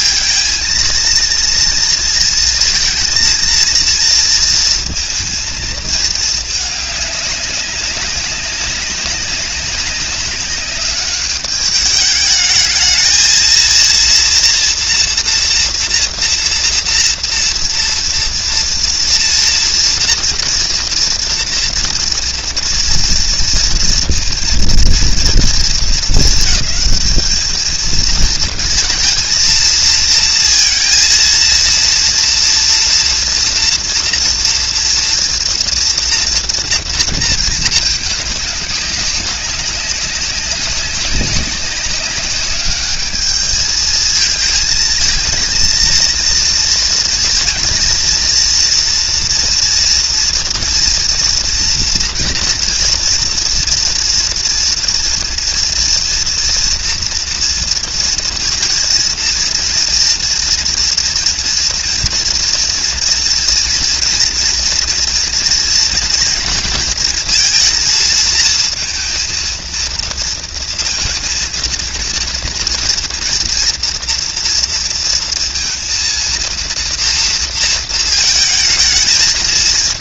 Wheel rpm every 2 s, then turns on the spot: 230, 230, 230, 210, 200, 200, 220, 230, 240, 230, 230, 230, 230, 220, 220, 230, 230, 230, 230, 200, 190, 200, 230, 230, 230, 230, 230, 230, 230, 230, 230, 240, 230, 230, 220, 230, 230, 230, 230, 220.
none